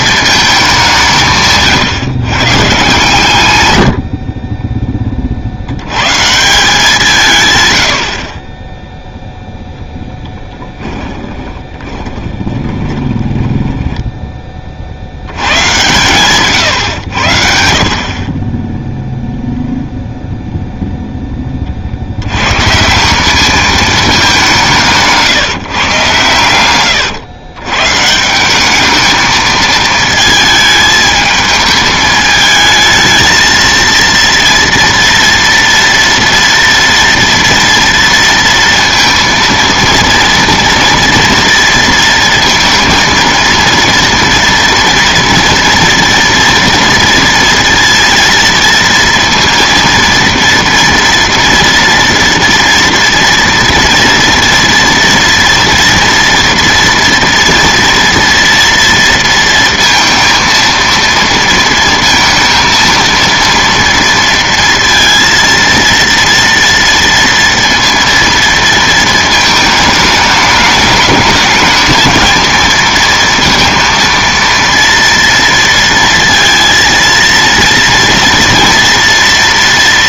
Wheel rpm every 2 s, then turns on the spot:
200, 140, 20, 170, 20, 10, 20, 30, 130, 20, 0, 140, 180, 110, 190, 220, 220, 230, 230, 230, 230, 230, 230, 230, 230, 230, 230, 230, 230, 230, 230, 220, 230, 230, 230, 210, 230, 230, 230, 230.
4-6 10-14